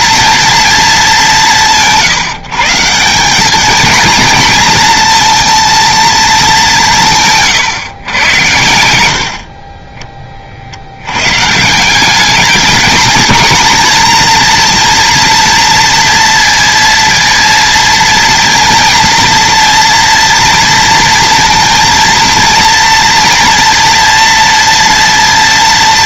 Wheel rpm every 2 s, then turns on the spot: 220, 160, 220, 190, 90, 80, 230, 230, 230, 230, 230, 230, 230.
8-10